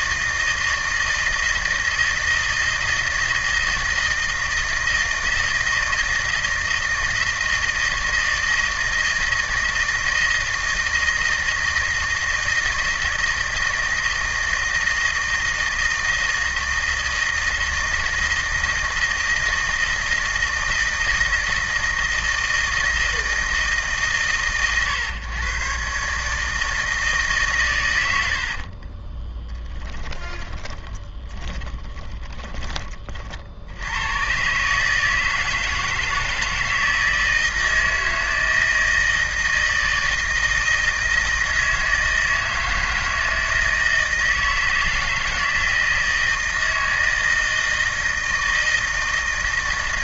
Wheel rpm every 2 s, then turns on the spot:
160, 160, 160, 160, 160, 160, 160, 160, 160, 160, 160, 160, 110, 160, 50, 20, 30, 140, 160, 160, 160, 160, 160, 160, 160.
28-32